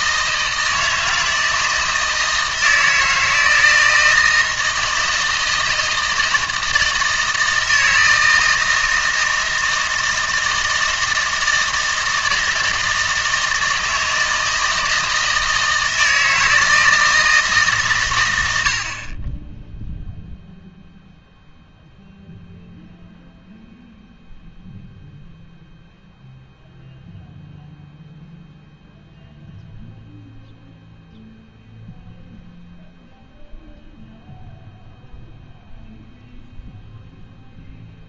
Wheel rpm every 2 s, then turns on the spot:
160, 160, 160, 160, 160, 160, 160, 160, 160, 80, 0, 0, 0, 0, 0, 0, 0, 0, 0.
none